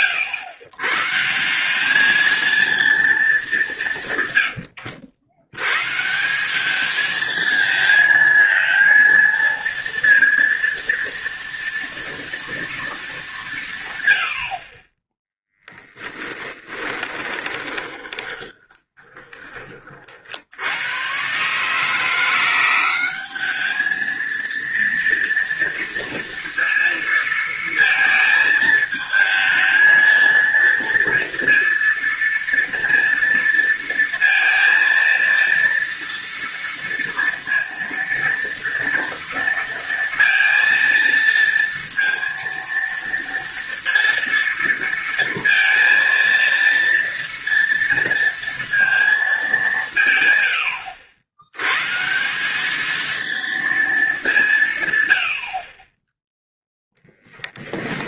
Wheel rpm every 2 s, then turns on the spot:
120, 230, 90, 210, 230, 230, 230, 30, 20, 20, 90, 180, 230, 230, 220, 230, 230, 230, 230, 230, 230, 230, 230, 230, 230, 90, 210, 150, 0.
16-20